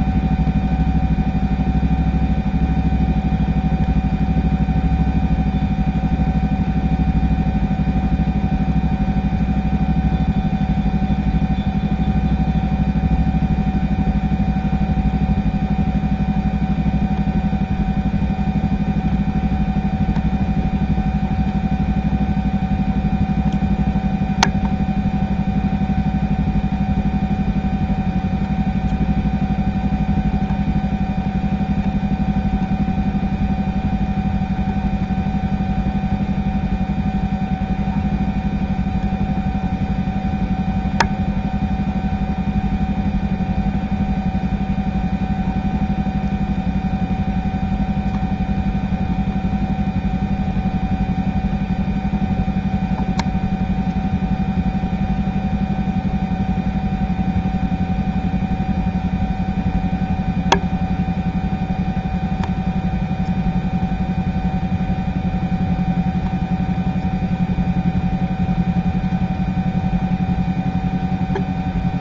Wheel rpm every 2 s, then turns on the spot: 0, 0, 0, 0, 0, 0, 0, 0, 0, 0, 0, 0, 0, 0, 0, 0, 0, 0, 0, 0, 0, 0, 0, 0, 0, 0, 0, 0, 0, 0, 0, 0, 0, 0, 0, 0.
none